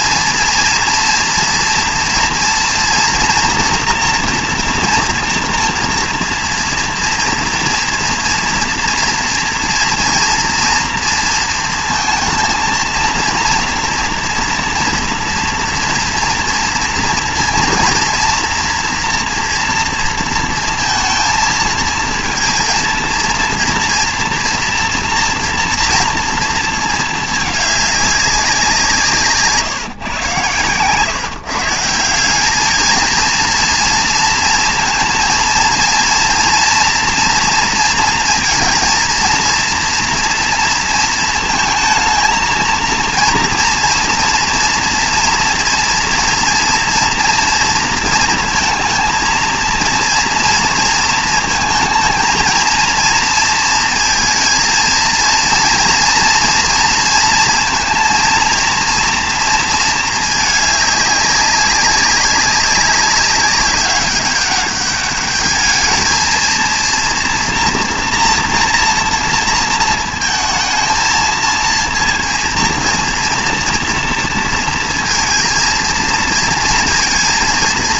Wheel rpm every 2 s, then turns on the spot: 230, 230, 230, 230, 230, 230, 230, 230, 230, 230, 230, 230, 230, 230, 190, 130, 200, 230, 230, 230, 230, 220, 230, 230, 230, 230, 230, 220, 230, 230, 210, 190, 200, 230, 240, 220, 230, 230, 230.
none